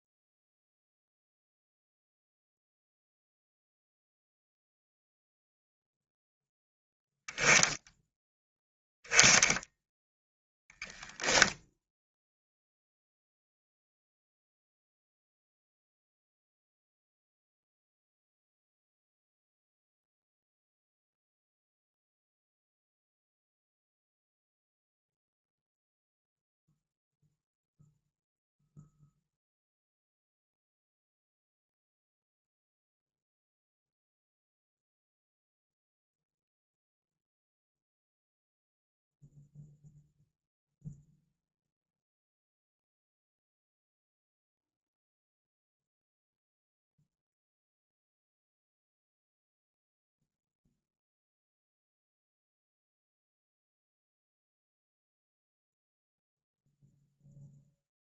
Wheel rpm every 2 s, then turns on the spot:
0, 0, 0, 0, 0, 10, 0, 0, 0, 0, 0, 0, 0, 0, 0, 0, 0, 0, 0, 0, 0, 0, 0, 0, 0, 0, 0, 0, 0.
none